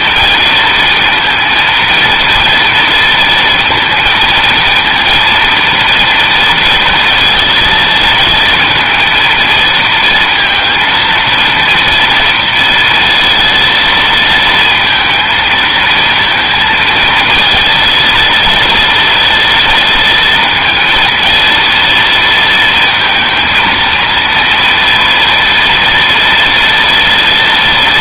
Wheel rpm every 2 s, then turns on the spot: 230, 230, 230, 230, 230, 230, 230, 230, 230, 230, 230, 230, 230, 240.
none